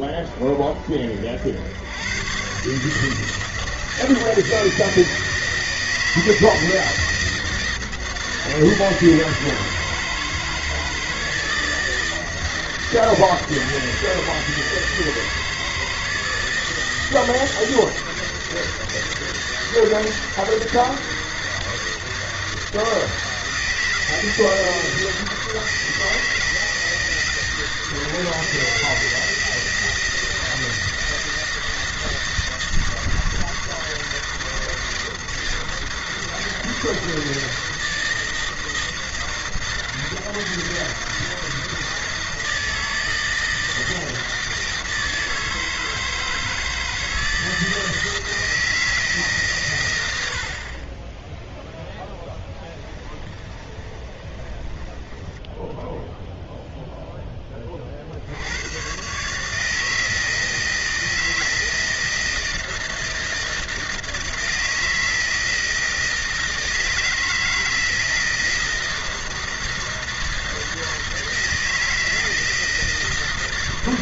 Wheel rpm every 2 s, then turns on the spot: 40, 130, 160, 160, 160, 160, 160, 160, 160, 160, 160, 160, 160, 160, 160, 160, 160, 160, 160, 160, 160, 160, 160, 160, 160, 60, 10, 30, 0, 90, 160, 160, 160, 160, 160, 160, 160.
52-56